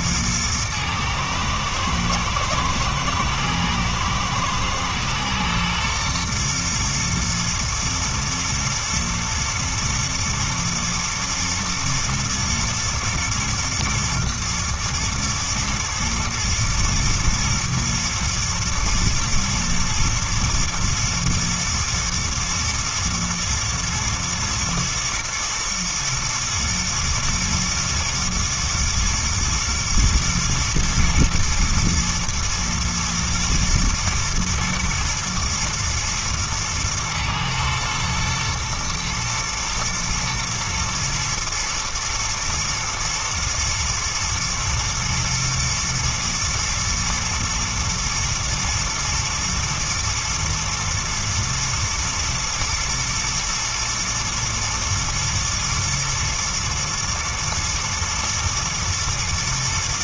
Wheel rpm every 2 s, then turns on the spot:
110, 110, 110, 110, 110, 120, 110, 120, 120, 110, 120, 120, 110, 110, 110, 120, 110, 120, 110, 110, 120, 110, 120, 110, 110, 110, 120, 110, 110, 110.
none